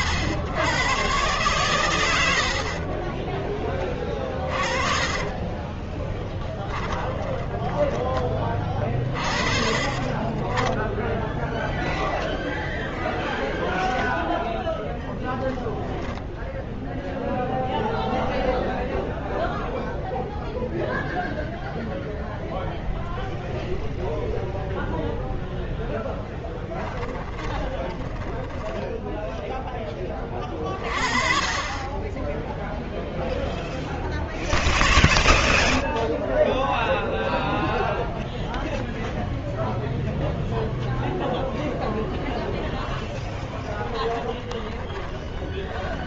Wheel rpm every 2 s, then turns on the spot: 100, 50, 40, 10, 40, 30, 0, 0, 0, 0, 0, 0, 0, 10, 10, 30, 0, 0, 0, 0, 0, 0, 10.
4-10 26-30 44-46